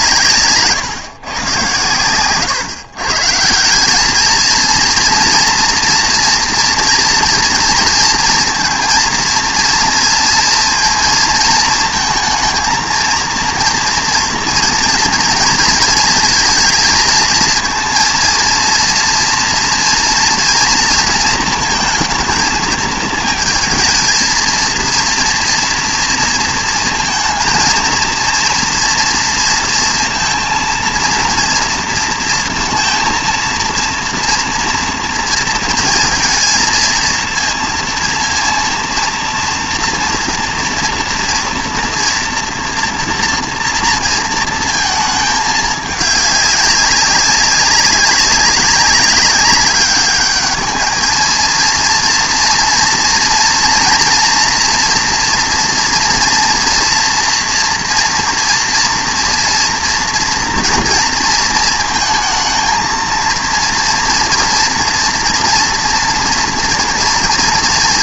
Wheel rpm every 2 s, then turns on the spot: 140, 130, 230, 230, 220, 230, 230, 230, 230, 230, 230, 220, 230, 230, 230, 230, 230, 230, 230, 230, 230, 230, 230, 200, 200, 220, 230, 230, 230, 230, 230, 220, 240, 230.
none